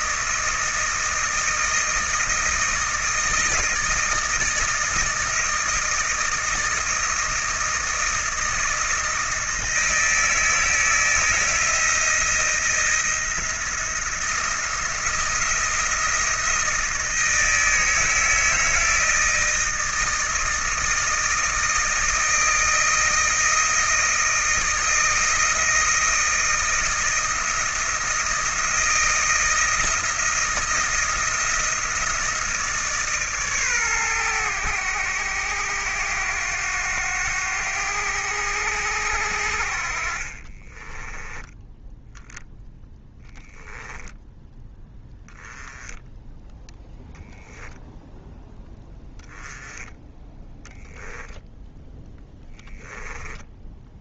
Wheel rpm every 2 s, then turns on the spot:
160, 160, 160, 160, 160, 160, 170, 170, 160, 160, 160, 160, 160, 160, 160, 160, 150, 100, 90, 90, 20, 0, 10, 10, 10, 0, 10.
40-42 52-54